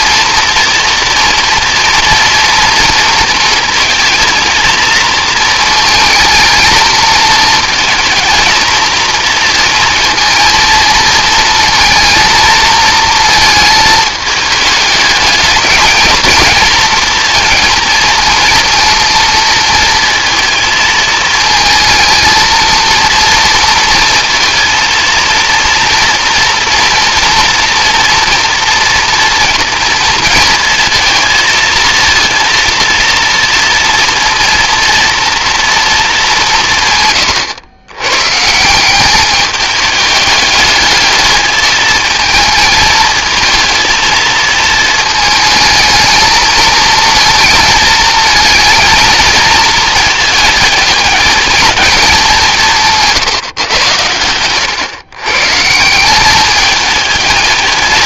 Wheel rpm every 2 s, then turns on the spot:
230, 240, 230, 230, 230, 230, 220, 220, 220, 230, 220, 230, 230, 230, 240, 230, 230, 230, 190, 150, 210, 220, 220, 220, 230, 220, 190, 110, 200.
none